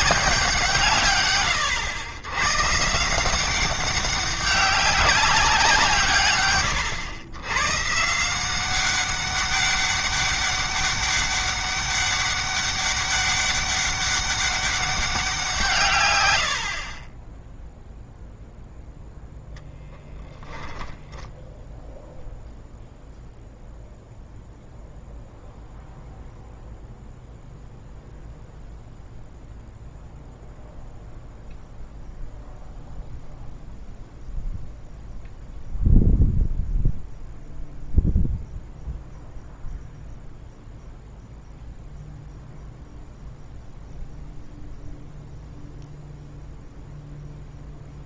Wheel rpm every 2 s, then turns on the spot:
150, 150, 190, 100, 190, 200, 200, 200, 40, 0, 10, 0, 0, 0, 0, 0, 0, 0, 0, 0, 0, 0, 0, 0.
20-22